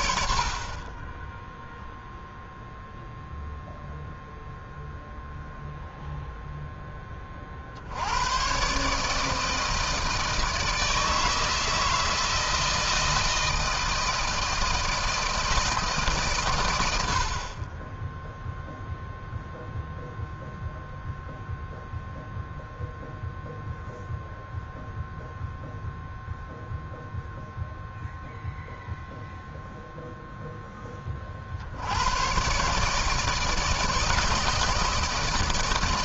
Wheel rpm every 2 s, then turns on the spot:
40, 0, 0, 0, 120, 160, 160, 160, 120, 0, 0, 0, 0, 0, 0, 10, 120, 160.
none